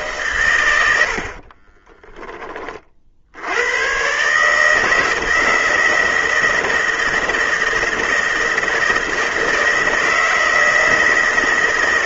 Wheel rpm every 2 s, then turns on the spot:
110, 30, 150, 160, 160, 160.
none